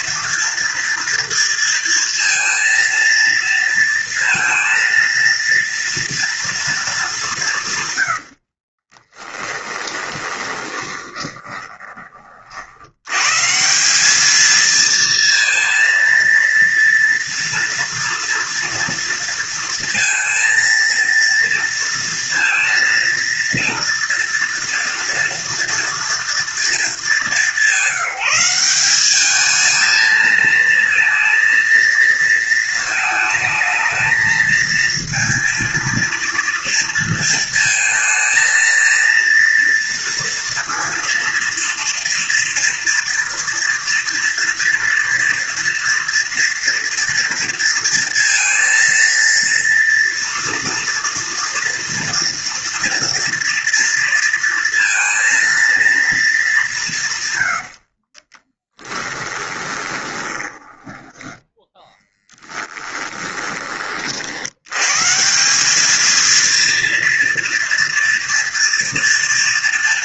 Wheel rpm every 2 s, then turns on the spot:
230, 230, 230, 210, 30, 20, 100, 230, 230, 230, 230, 230, 230, 210, 200, 230, 220, 230, 230, 230, 230, 230, 230, 230, 230, 230, 230, 230, 170, 10, 10, 20, 140, 230, 230.
8-12 58-64